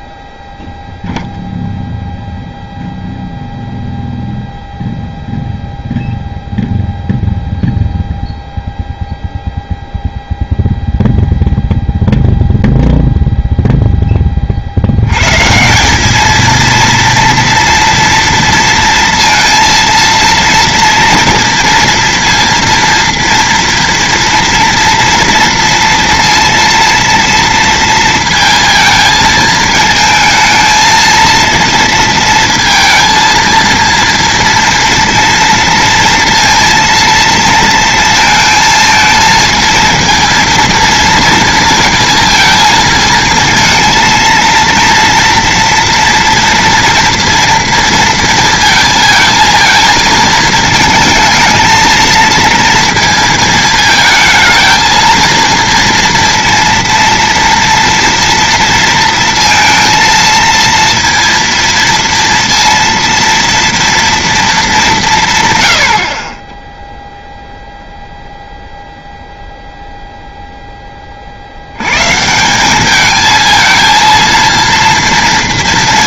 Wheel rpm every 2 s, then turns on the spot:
0, 0, 0, 0, 0, 0, 0, 70, 230, 230, 230, 230, 230, 230, 220, 220, 230, 230, 230, 220, 230, 220, 230, 230, 220, 220, 220, 220, 230, 230, 230, 230, 210, 10, 0, 10, 200, 230.
none